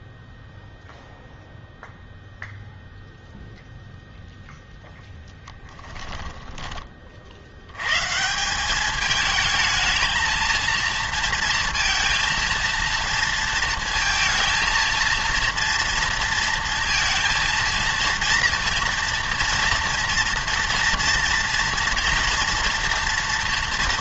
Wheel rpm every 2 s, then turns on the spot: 0, 0, 0, 20, 190, 230, 230, 220, 230, 230, 230, 230.
none